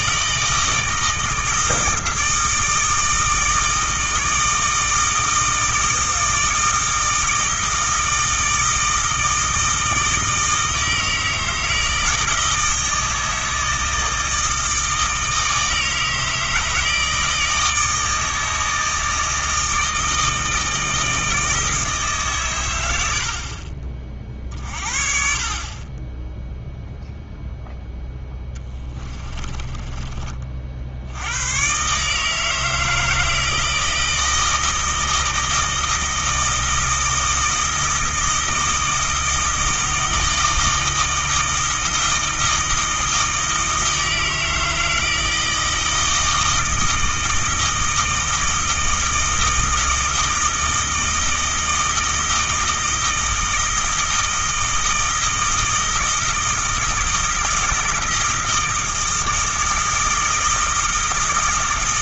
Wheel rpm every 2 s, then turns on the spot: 160, 160, 160, 160, 160, 160, 160, 160, 160, 160, 160, 100, 50, 0, 20, 60, 160, 160, 160, 160, 160, 160, 160, 160, 160, 160, 160, 160, 160, 160, 160.
28-30